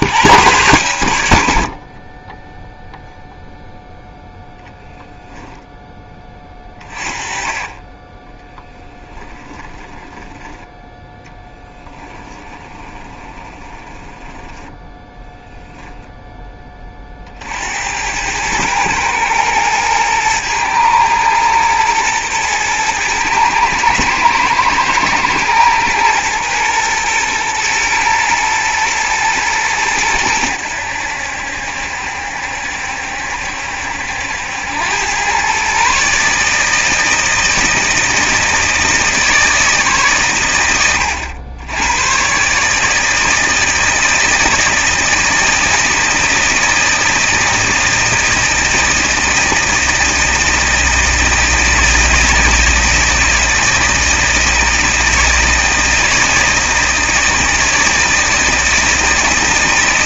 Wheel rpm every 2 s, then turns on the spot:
100, 0, 10, 30, 10, 10, 20, 10, 30, 110, 110, 110, 110, 110, 110, 90, 70, 90, 160, 160, 110, 150, 160, 160, 160, 160, 160, 160, 160, 160.
8-10 12-16